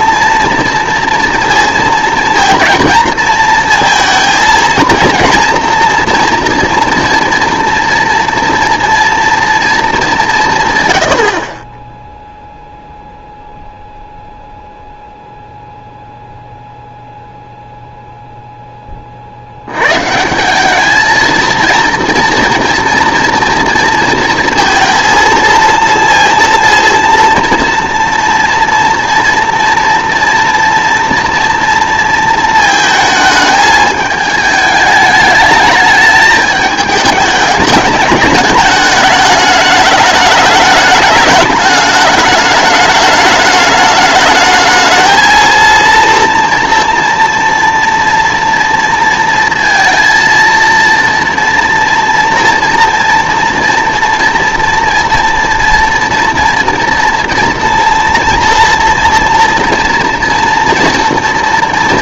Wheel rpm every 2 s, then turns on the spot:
230, 230, 230, 230, 230, 150, 0, 0, 0, 10, 190, 230, 230, 230, 230, 230, 220, 210, 210, 210, 210, 210, 220, 230, 230, 230, 240, 230, 230, 230, 230.
none